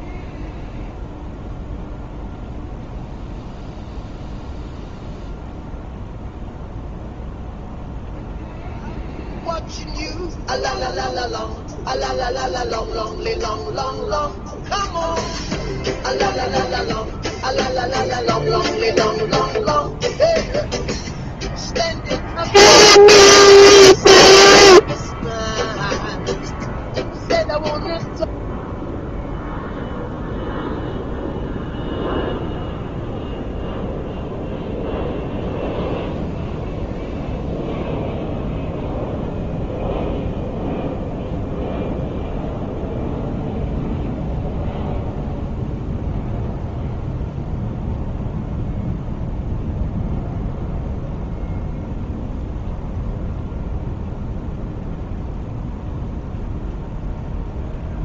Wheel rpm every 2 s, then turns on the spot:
0, 0, 0, 0, 0, 0, 0, 0, 0, 0, 0, 0, 0, 0, 0, 0, 0, 0, 0, 0, 0, 0, 0, 0, 0, 0, 0, 0, 0.
none